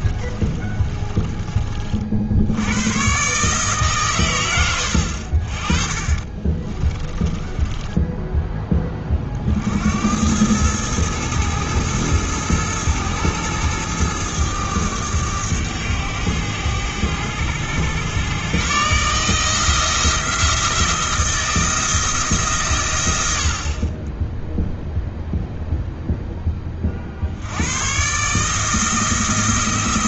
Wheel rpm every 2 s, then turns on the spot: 20, 90, 100, 30, 20, 100, 110, 100, 100, 140, 170, 140, 0, 30, 160.
0-2 6-8